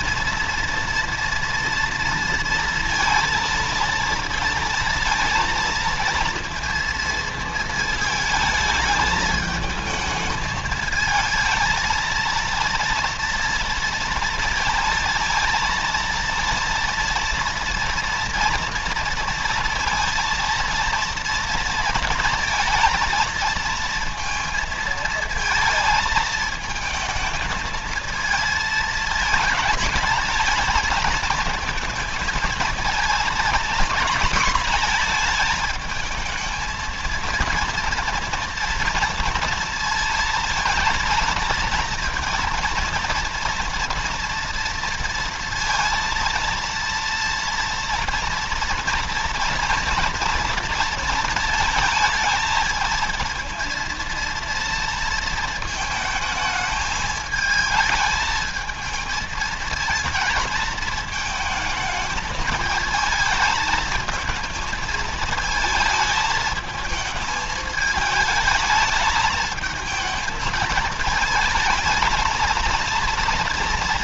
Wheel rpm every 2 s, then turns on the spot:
230, 230, 230, 230, 220, 220, 230, 230, 230, 230, 230, 230, 230, 220, 220, 220, 230, 230, 230, 230, 230, 230, 230, 230, 230, 230, 220, 230, 210, 220, 220, 220, 220, 210, 220, 220, 230.
none